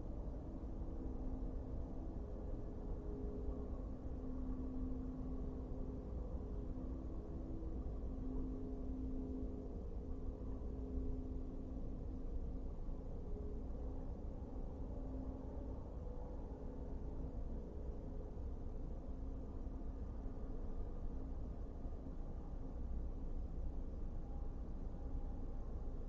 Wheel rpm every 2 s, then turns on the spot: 0, 0, 0, 0, 0, 0, 0, 0, 0, 0, 0, 0, 0.
none